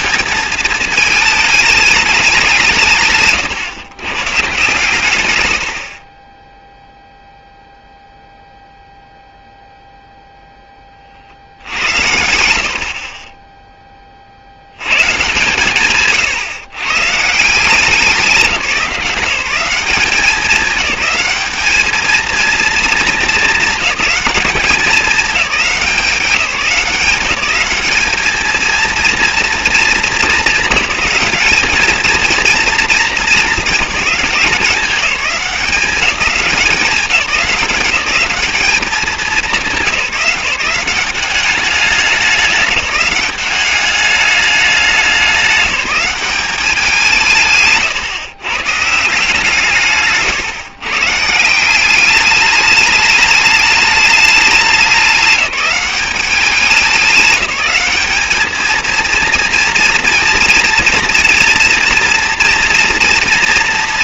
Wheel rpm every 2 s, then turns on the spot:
220, 180, 140, 10, 0, 10, 80, 70, 140, 170, 200, 230, 210, 180, 220, 210, 230, 190, 200, 200, 180, 200, 200, 190, 140, 150, 210, 210, 200, 210, 230, 230.
none